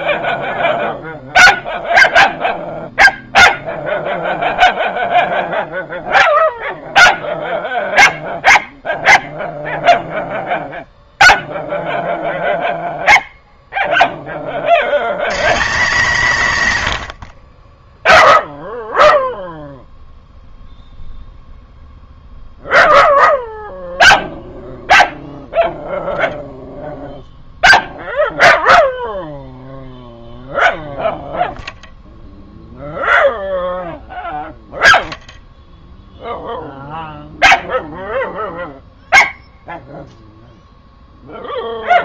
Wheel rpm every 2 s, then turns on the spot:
0, 0, 0, 0, 0, 0, 0, 90, 110, 0, 0, 0, 0, 0, 0, 0, 0, 0, 0, 0, 0.
none